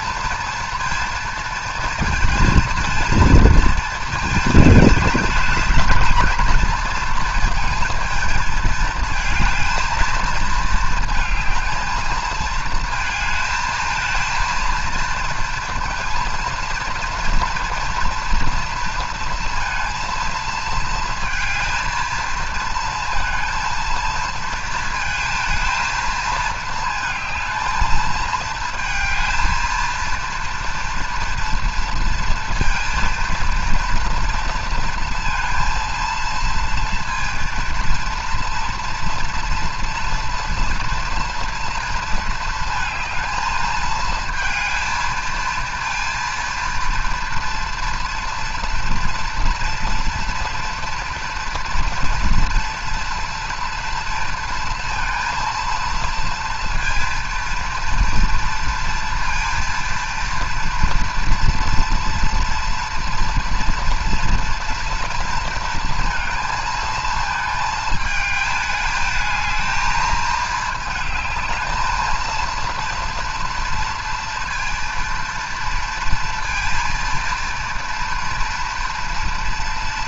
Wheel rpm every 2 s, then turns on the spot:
230, 220, 220, 220, 220, 220, 220, 230, 230, 230, 220, 230, 220, 220, 230, 230, 230, 230, 230, 230, 230, 230, 230, 230, 230, 240, 230, 230, 230, 230, 230, 240, 240, 230, 220, 220, 230, 230, 230, 230.
none